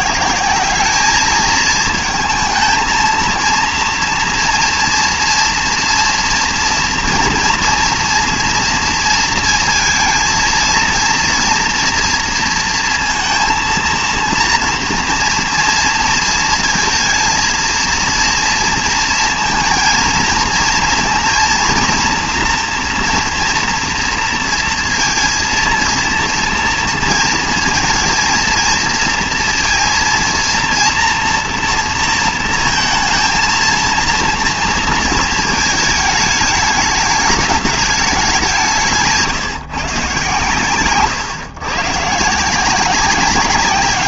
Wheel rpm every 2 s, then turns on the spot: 190, 220, 230, 230, 230, 230, 230, 230, 230, 230, 230, 230, 230, 230, 230, 230, 220, 230, 210, 180, 120, 150.
none